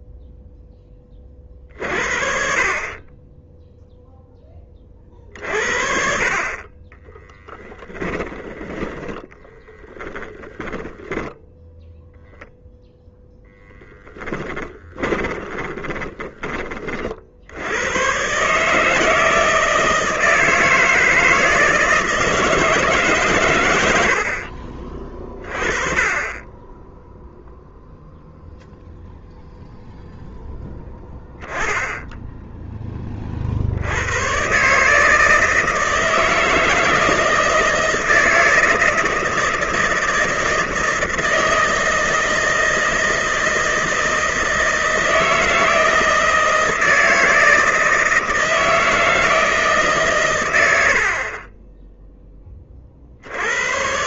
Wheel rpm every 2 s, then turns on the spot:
20, 30, 30, 20, 20, 10, 0, 20, 40, 160, 160, 150, 40, 10, 0, 10, 20, 150, 160, 160, 160, 160, 160, 160, 160, 70, 50.
10-12 14-16